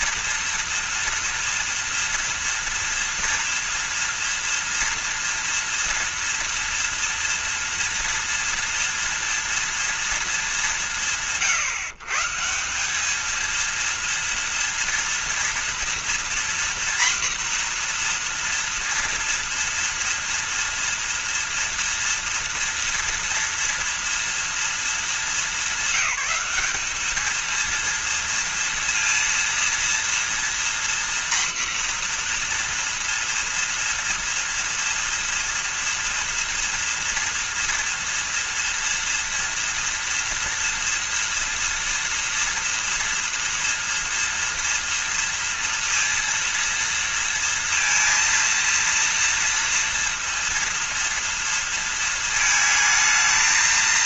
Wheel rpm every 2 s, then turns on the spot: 230, 230, 230, 230, 230, 160, 180, 230, 240, 240, 230, 230, 230, 210, 230, 240, 240, 230, 240, 230, 230, 230, 230, 230, 230, 230, 220.
none